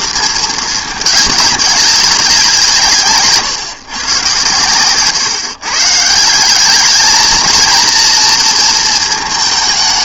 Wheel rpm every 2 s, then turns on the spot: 220, 170, 130, 200, 230.
none